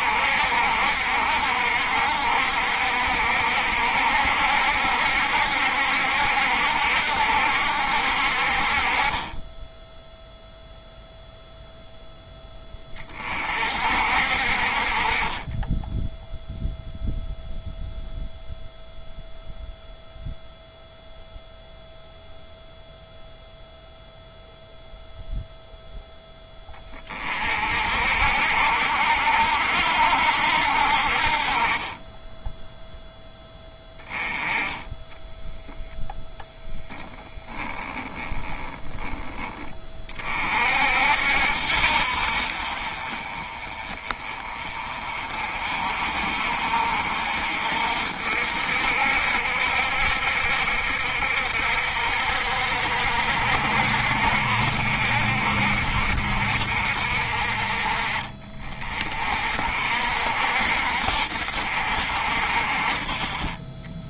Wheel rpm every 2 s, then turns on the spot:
60, 60, 70, 70, 40, 0, 30, 40, 0, 0, 0, 0, 0, 20, 70, 60, 0, 10, 0, 10, 50, 40, 30, 50, 60, 70, 60, 60, 60, 40, 60, 40.
none